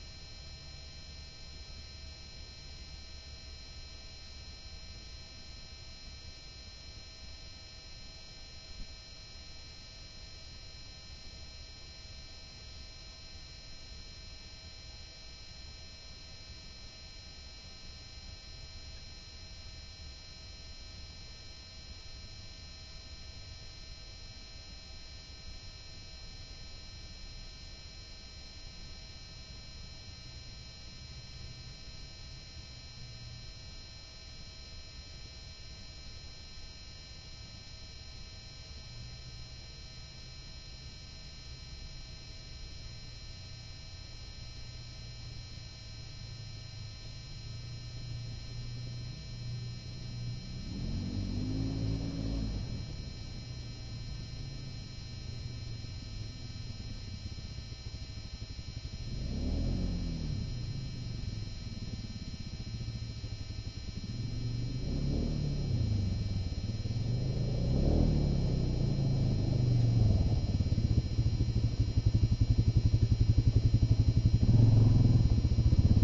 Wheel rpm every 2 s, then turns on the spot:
0, 0, 0, 0, 0, 0, 0, 0, 0, 0, 0, 0, 0, 0, 0, 0, 0, 0, 0, 0, 0, 0, 0, 0, 0, 0, 0, 0, 0, 0, 0, 0, 0, 0, 0, 0, 0, 0.
none